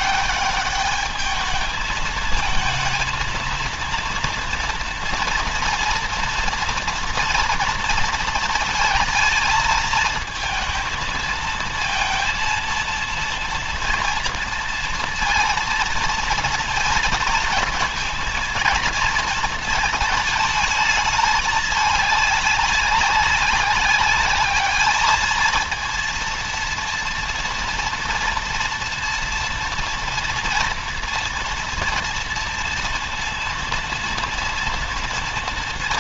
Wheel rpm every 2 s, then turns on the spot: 210, 220, 230, 230, 220, 220, 230, 230, 230, 220, 220, 200, 210, 230, 230, 230, 230, 230.
none